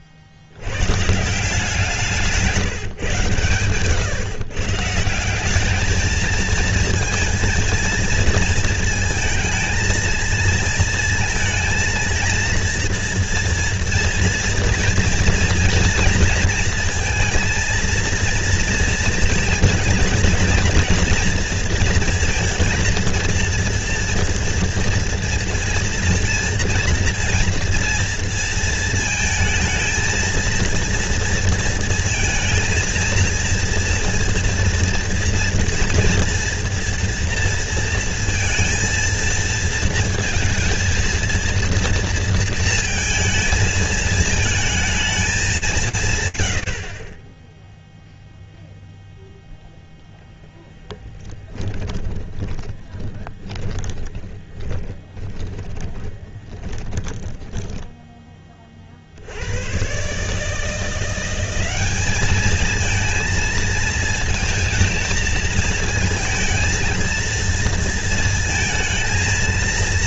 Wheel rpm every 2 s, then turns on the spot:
80, 160, 140, 220, 230, 230, 230, 230, 230, 230, 230, 230, 230, 230, 230, 230, 230, 230, 230, 230, 220, 230, 220, 90, 0, 0, 10, 10, 20, 20, 150, 220, 230, 230, 220.
52-58